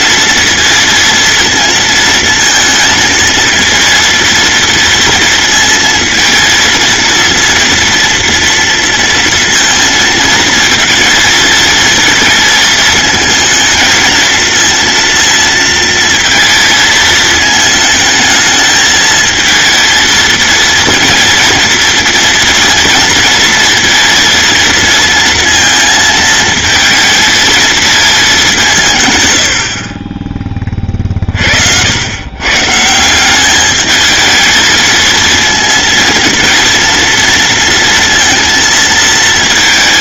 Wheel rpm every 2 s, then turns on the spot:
230, 230, 230, 230, 230, 230, 220, 230, 220, 220, 230, 230, 230, 230, 170, 20, 140, 220, 230, 230.
none